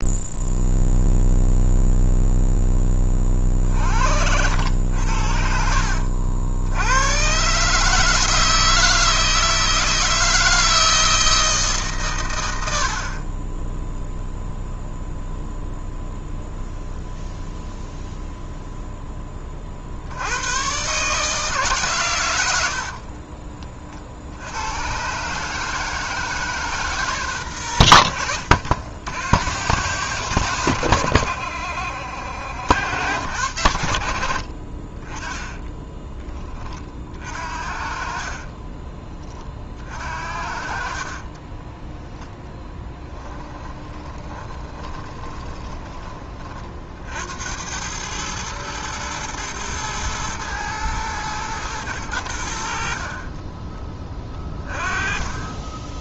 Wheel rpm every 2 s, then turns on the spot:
0, 10, 90, 80, 160, 160, 90, 0, 0, 0, 110, 70, 90, 150, 80, 90, 70, 50, 30, 30, 50, 10, 20, 40, 110, 110, 70, 20.
38-46